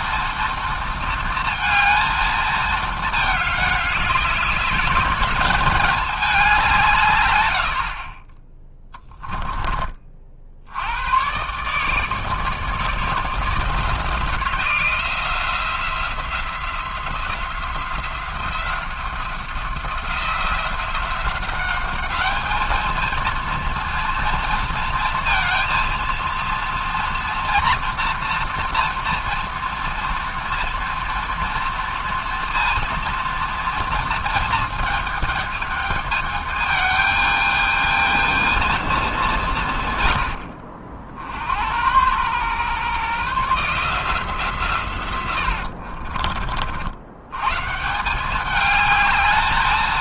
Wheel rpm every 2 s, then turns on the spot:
230, 220, 200, 190, 30, 70, 160, 170, 170, 170, 180, 220, 230, 230, 240, 230, 230, 220, 210, 220, 60, 120, 150, 60, 210.
8-10